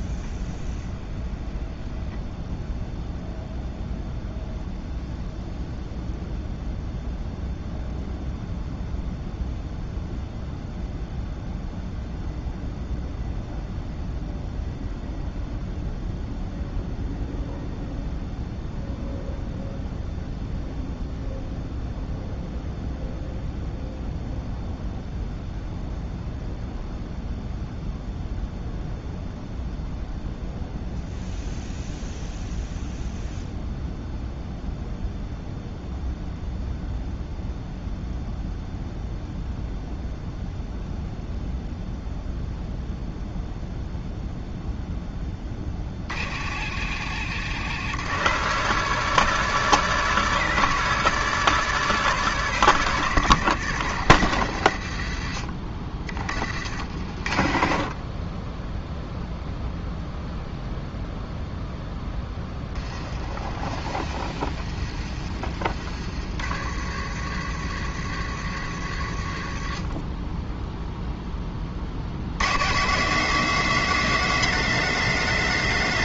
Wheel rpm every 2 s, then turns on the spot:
0, 0, 0, 0, 0, 0, 0, 0, 0, 0, 0, 0, 0, 0, 0, 0, 0, 0, 0, 0, 0, 0, 0, 50, 120, 130, 120, 90, 50, 10, 0, 20, 30, 60, 70, 10, 160, 220.
62-66